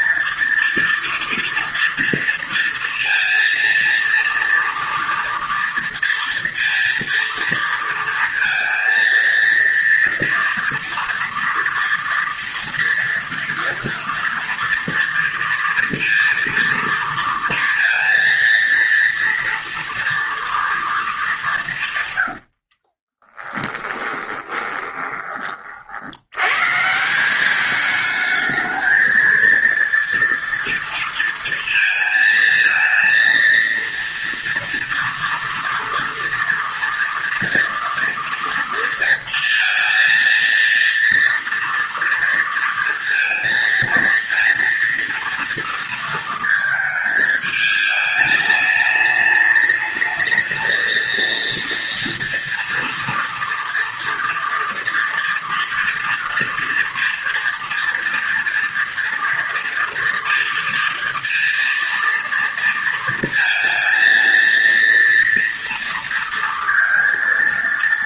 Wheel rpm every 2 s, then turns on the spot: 230, 230, 230, 230, 230, 230, 230, 240, 230, 230, 220, 50, 20, 160, 230, 230, 230, 230, 230, 230, 230, 230, 230, 220, 210, 230, 230, 230, 230, 230, 230, 230, 230, 230.
22-26